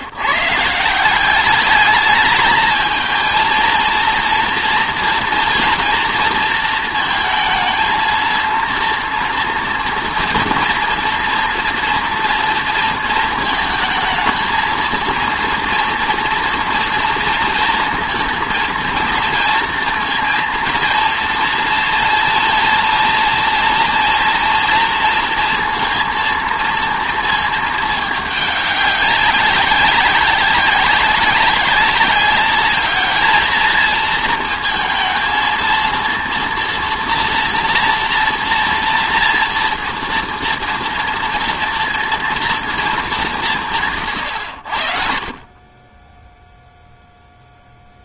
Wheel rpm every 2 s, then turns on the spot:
150, 220, 230, 230, 230, 240, 230, 230, 230, 230, 230, 230, 230, 230, 200, 190, 200, 230, 230, 230, 230, 230, 90, 0.
none